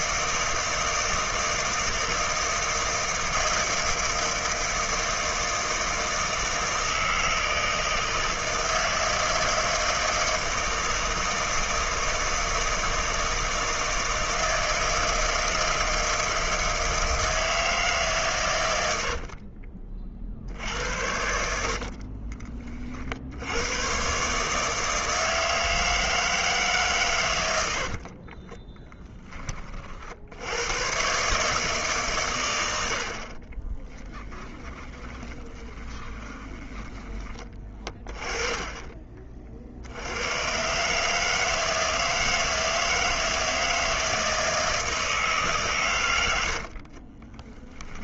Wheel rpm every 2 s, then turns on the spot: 160, 160, 160, 160, 160, 160, 160, 160, 160, 110, 70, 30, 150, 150, 30, 110, 90, 20, 20, 30, 130, 160, 160, 60.
28-30 34-36 46-48